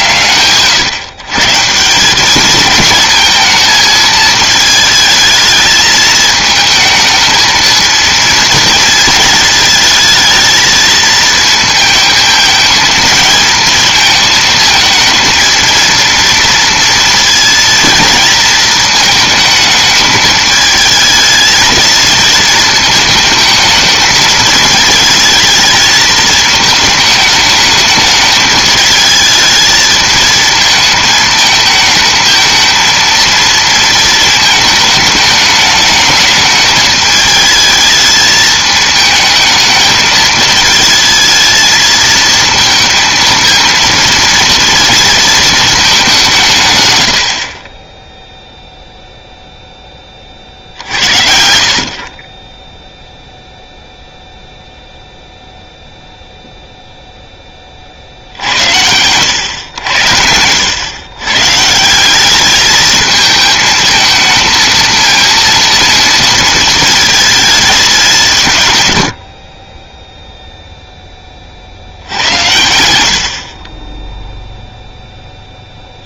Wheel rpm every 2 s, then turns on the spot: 130, 220, 220, 220, 230, 230, 220, 220, 230, 220, 220, 220, 220, 220, 210, 220, 220, 220, 210, 220, 220, 220, 230, 150, 0, 50, 10, 0, 0, 80, 100, 210, 230, 230, 160, 0, 80, 0.
none